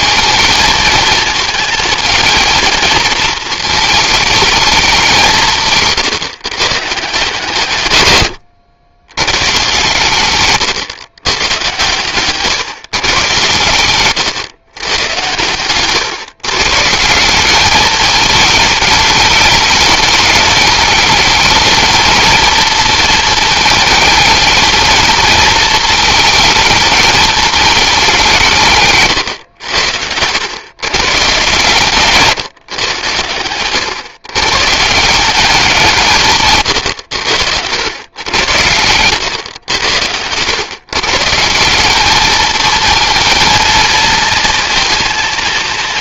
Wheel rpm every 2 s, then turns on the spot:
220, 220, 170, 160, 110, 120, 120, 120, 180, 210, 220, 220, 220, 210, 120, 130, 120, 180, 100, 120, 140, 220, 230.
none